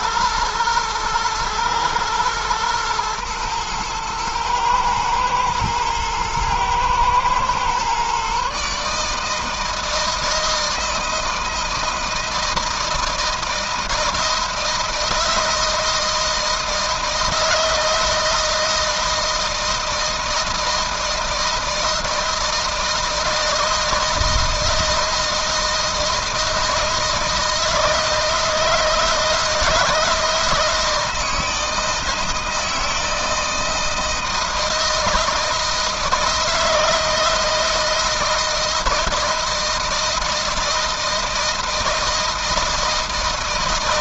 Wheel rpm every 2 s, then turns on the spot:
110, 110, 110, 110, 140, 160, 160, 160, 160, 160, 160, 160, 160, 160, 160, 160, 160, 160, 160, 160, 160, 160.
none